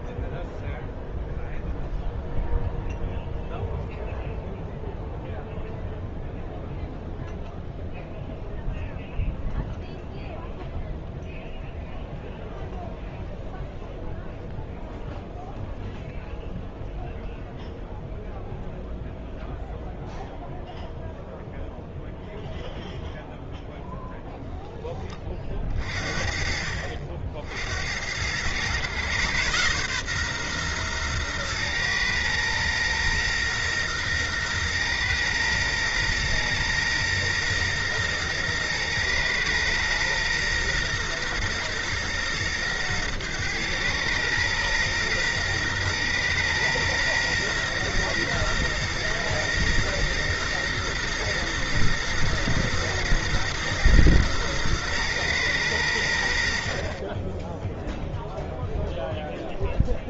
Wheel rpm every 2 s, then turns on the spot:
0, 0, 0, 0, 0, 0, 0, 0, 0, 0, 0, 0, 10, 50, 110, 130, 120, 120, 120, 120, 120, 120, 110, 120, 120, 120, 120, 120, 50, 0.
none